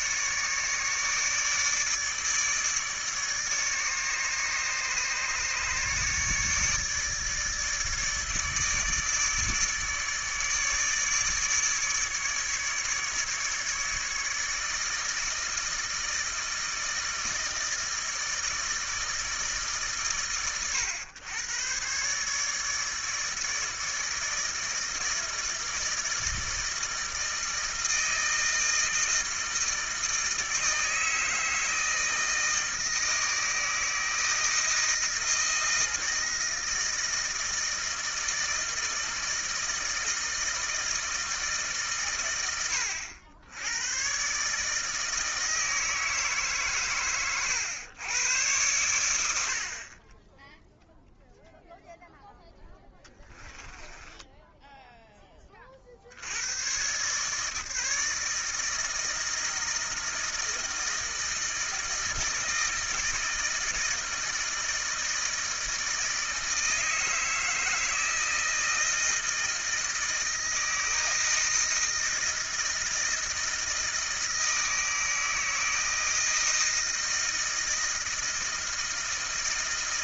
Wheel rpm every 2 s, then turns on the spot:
150, 150, 150, 150, 150, 150, 150, 160, 160, 160, 100, 150, 160, 160, 160, 160, 160, 160, 160, 160, 160, 90, 150, 130, 100, 0, 10, 10, 110, 160, 160, 160, 160, 160, 160, 160, 160, 160, 160, 160.
52-56